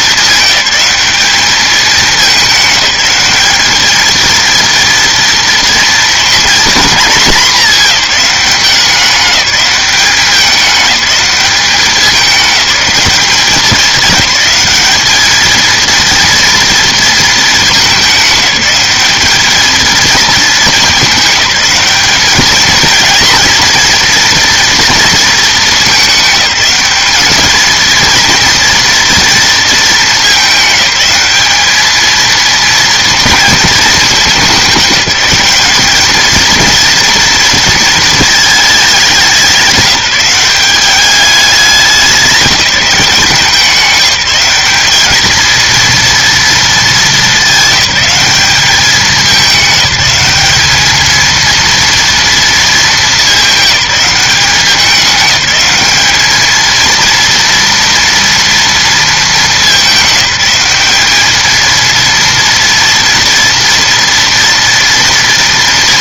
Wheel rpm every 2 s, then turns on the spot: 200, 210, 230, 220, 200, 200, 210, 210, 230, 210, 220, 220, 230, 210, 230, 210, 230, 200, 230, 210, 200, 190, 200, 220, 200, 210, 220, 200, 230, 230, 200, 230, 230.
none